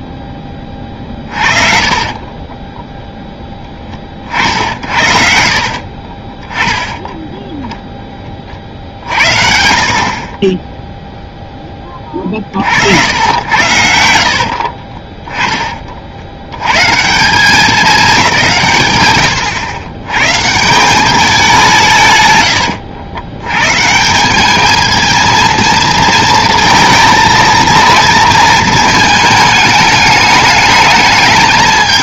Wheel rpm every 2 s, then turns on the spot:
10, 10, 50, 10, 40, 10, 50, 40, 110, 150, 160, 100, 210, 230, 220, 210.
2-4 14-16 22-24